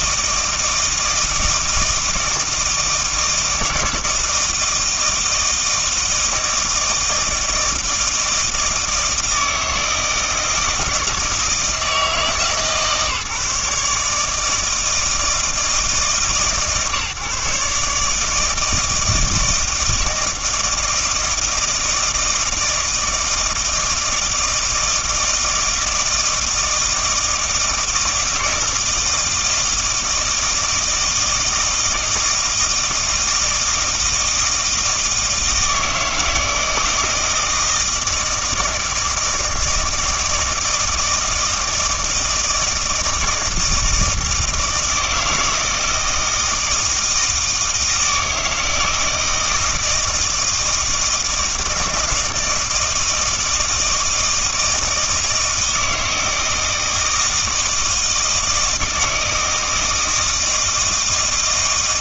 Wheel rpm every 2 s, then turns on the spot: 160, 160, 160, 160, 160, 160, 150, 160, 140, 160, 160, 160, 160, 160, 160, 160, 160, 160, 160, 160, 160, 160, 160, 160, 160, 160, 160, 160, 160, 160, 160.
none